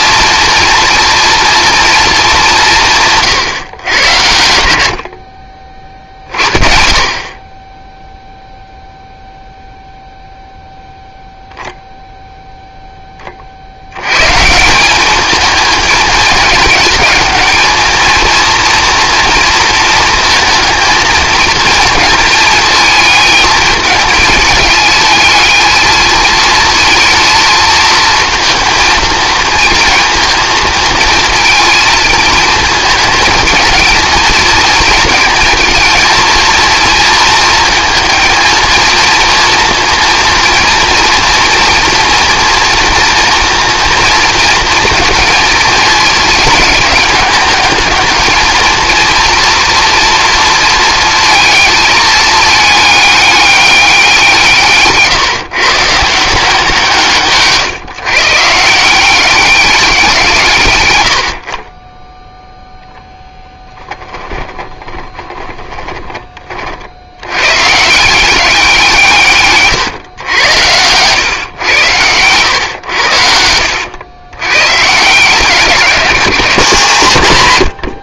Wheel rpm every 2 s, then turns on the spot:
230, 170, 80, 50, 0, 0, 10, 180, 220, 230, 230, 220, 220, 230, 230, 220, 220, 220, 230, 230, 230, 230, 230, 210, 230, 230, 210, 150, 160, 160, 110, 0, 20, 50, 170, 100, 110, 130, 150.
64-66 76-78